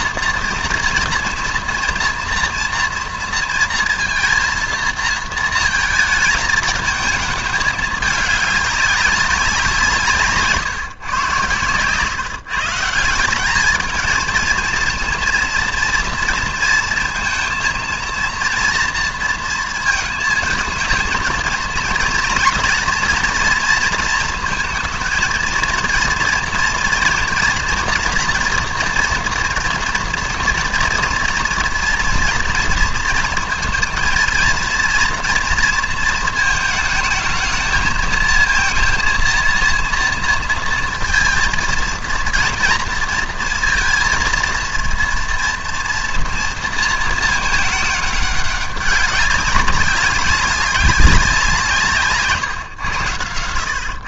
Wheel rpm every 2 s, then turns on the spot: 240, 230, 230, 220, 200, 140, 150, 230, 230, 230, 220, 230, 220, 230, 230, 230, 230, 230, 220, 230, 230, 230, 230, 230, 200, 190, 120.
none